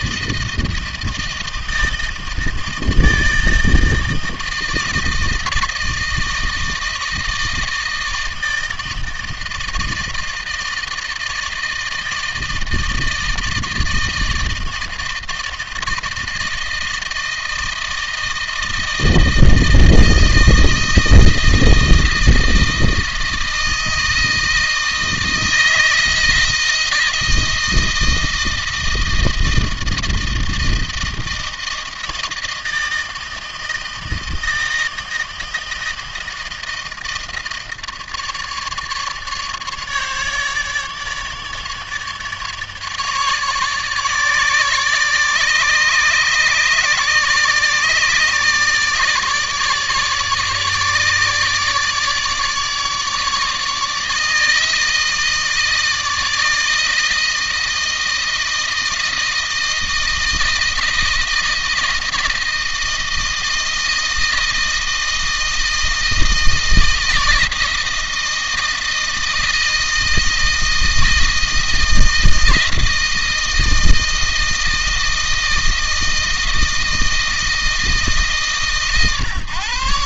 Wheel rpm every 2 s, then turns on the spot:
160, 160, 160, 160, 160, 160, 160, 160, 160, 160, 160, 160, 160, 160, 160, 160, 160, 160, 160, 150, 150, 150, 150, 150, 150, 150, 150, 160, 160, 160, 160, 160, 160, 160, 160, 160, 160, 160, 160, 140.
none